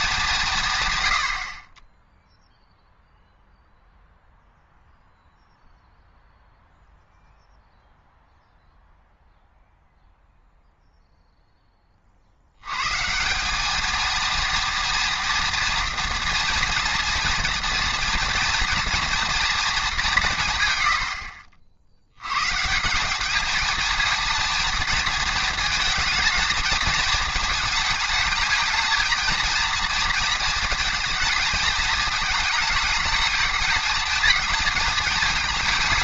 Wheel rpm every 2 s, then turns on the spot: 150, 0, 0, 0, 0, 0, 100, 230, 240, 230, 130, 150, 220, 220, 220, 230, 220, 220.
none